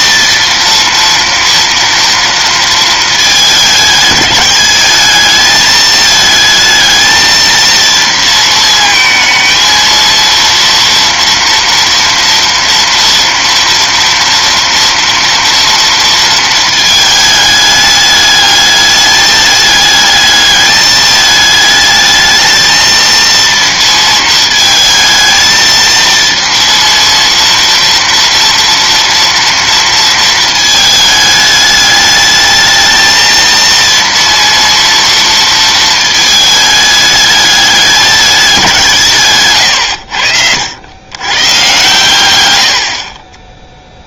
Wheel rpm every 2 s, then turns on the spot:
230, 230, 200, 220, 230, 230, 230, 230, 220, 210, 210, 220, 220, 230, 230, 220, 220, 230, 210, 200, 90, 90.
none